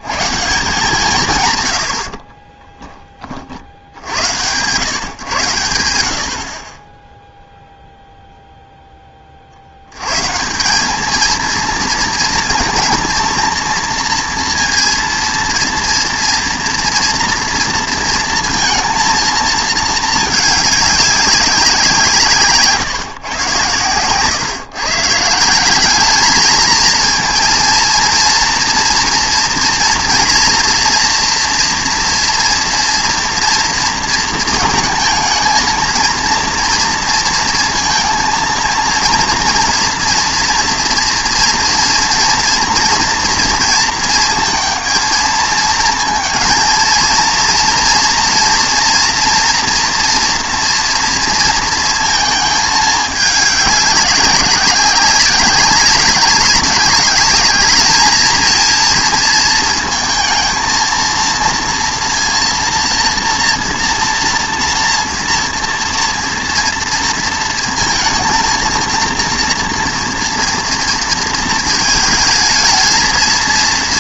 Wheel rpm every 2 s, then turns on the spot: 160, 20, 120, 30, 0, 180, 220, 230, 230, 220, 200, 140, 150, 220, 230, 230, 240, 230, 230, 230, 230, 230, 230, 230, 240, 230, 220, 190, 200, 230, 220, 230, 230, 230, 230, 230, 220.
2-4 6-8